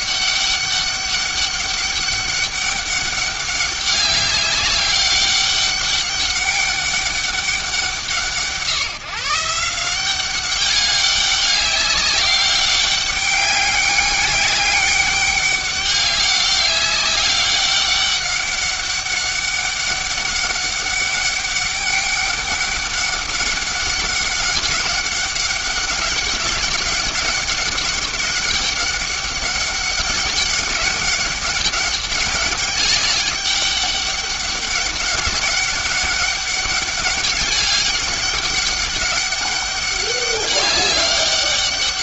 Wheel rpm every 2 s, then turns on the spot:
200, 200, 200, 200, 160, 200, 200, 200, 200, 200, 200, 200, 200, 200, 200, 200, 200, 200, 200, 200, 200.
none